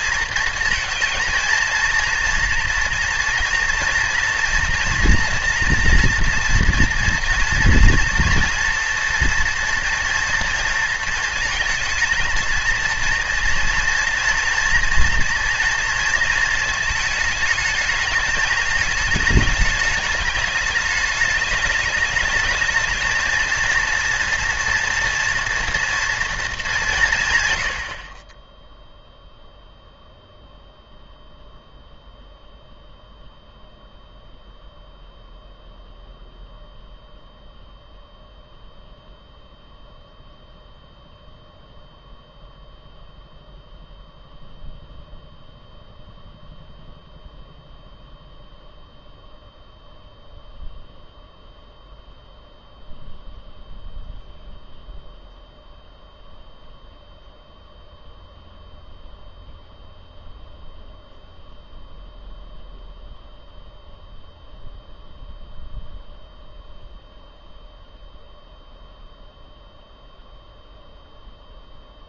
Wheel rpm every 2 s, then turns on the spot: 230, 230, 230, 230, 240, 230, 230, 230, 220, 220, 210, 220, 240, 190, 0, 0, 0, 0, 0, 0, 0, 0, 0, 0, 0, 0, 0, 0, 0, 0, 0, 0, 0, 0, 0, 0.
none